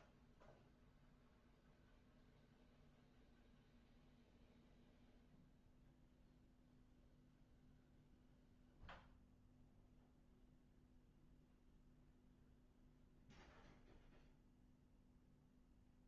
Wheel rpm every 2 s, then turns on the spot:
0, 0, 0, 0, 0, 0, 0, 0.
none